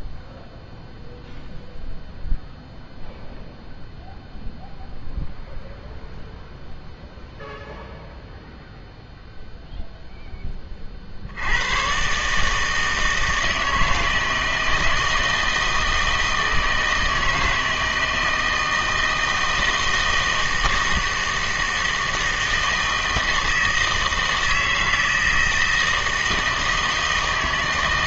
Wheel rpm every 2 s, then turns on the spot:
0, 0, 0, 0, 0, 20, 160, 160, 160, 160, 160, 160, 160, 160.
none